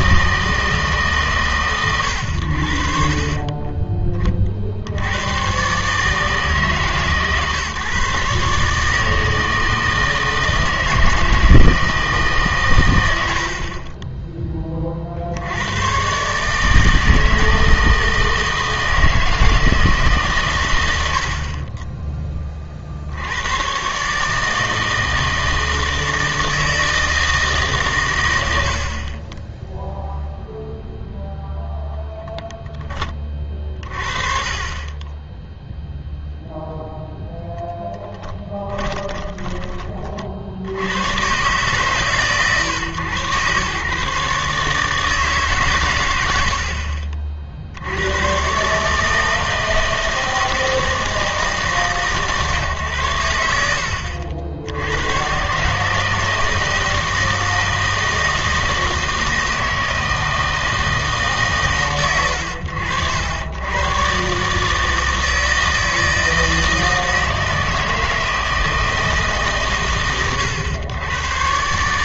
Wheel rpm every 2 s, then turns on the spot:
160, 70, 50, 150, 150, 160, 130, 20, 150, 160, 110, 40, 160, 160, 60, 0, 10, 30, 0, 20, 80, 130, 150, 70, 130, 160, 130, 80, 160, 160, 160, 90, 150, 160, 160, 110.
38-40